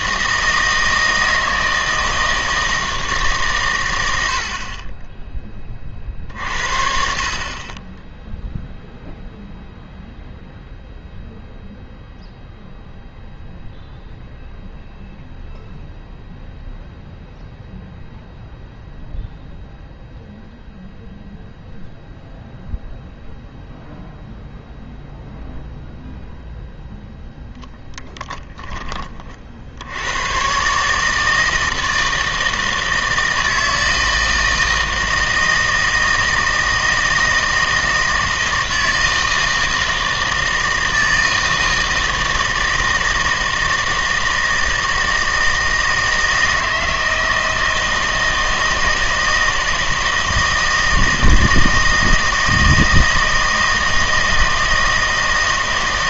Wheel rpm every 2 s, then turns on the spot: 160, 160, 50, 50, 0, 0, 0, 0, 0, 0, 0, 0, 0, 0, 20, 140, 160, 160, 160, 160, 160, 160, 160, 160, 160, 160, 160, 160.
none